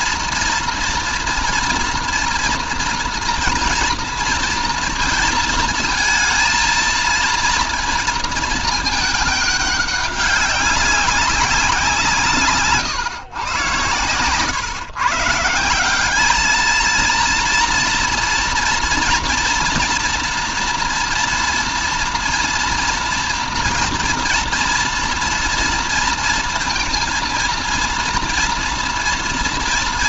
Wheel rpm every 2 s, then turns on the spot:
230, 230, 230, 230, 210, 200, 130, 130, 220, 230, 230, 230, 240, 230, 230.
none